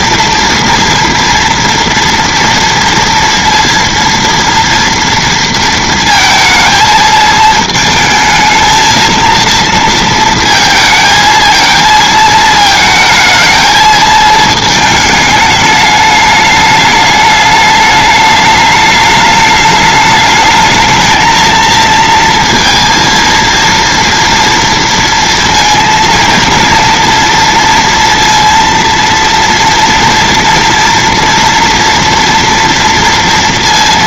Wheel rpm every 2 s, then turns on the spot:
230, 230, 230, 220, 220, 230, 220, 220, 210, 210, 210, 230, 230, 230, 230, 230, 230.
none